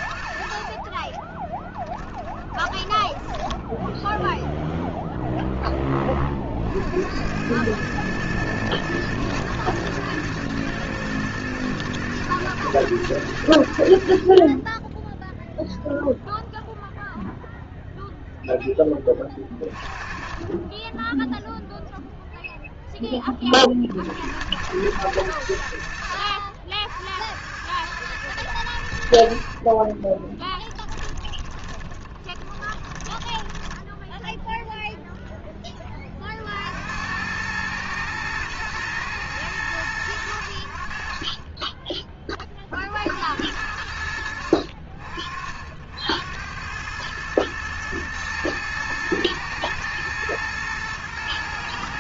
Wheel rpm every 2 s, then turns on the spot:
50, 20, 0, 50, 110, 110, 110, 30, 0, 10, 20, 0, 90, 60, 90, 10, 20, 0, 60, 110, 70, 30, 60, 90, 110, 110.
2-4 30-34